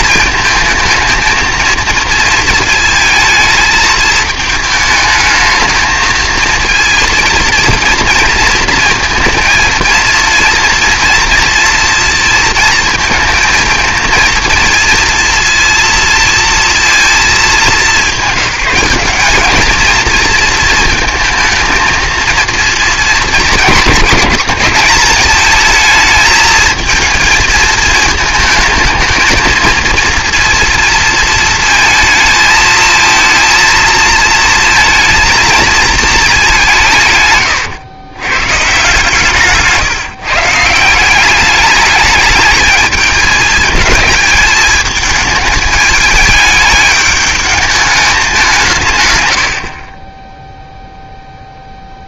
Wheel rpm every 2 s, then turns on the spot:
220, 230, 220, 220, 230, 230, 230, 230, 230, 190, 220, 220, 200, 220, 220, 230, 230, 230, 200, 130, 150, 220, 210, 210, 180, 0.
none